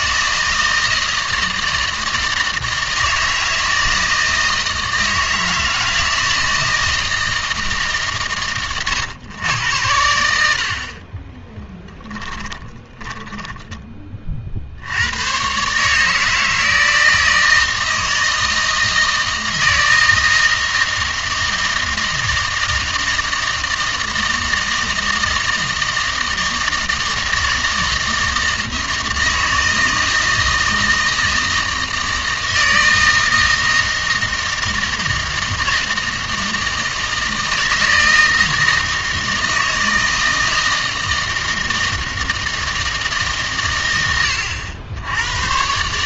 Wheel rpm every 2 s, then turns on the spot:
160, 160, 160, 160, 120, 40, 10, 80, 160, 160, 160, 160, 160, 160, 160, 160, 160, 160, 160, 160, 160, 160, 90.
12-14